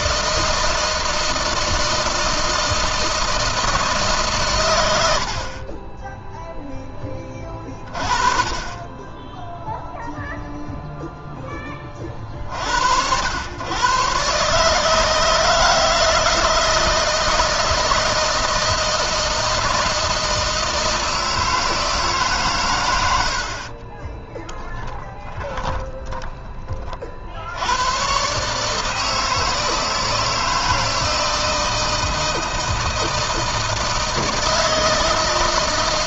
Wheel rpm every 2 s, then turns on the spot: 160, 160, 90, 10, 20, 0, 70, 150, 160, 160, 160, 100, 10, 40, 160, 160, 160, 160.
24-26